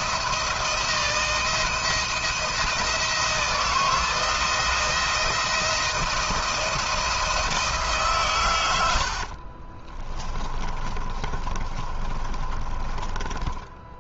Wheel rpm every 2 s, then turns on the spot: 160, 170, 160, 160, 90, 30, 30.
8-12